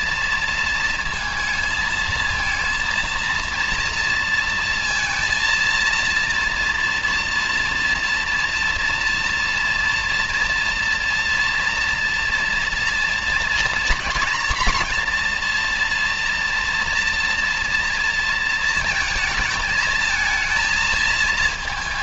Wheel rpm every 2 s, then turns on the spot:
230, 230, 230, 230, 230, 230, 230, 240, 230, 220, 220.
none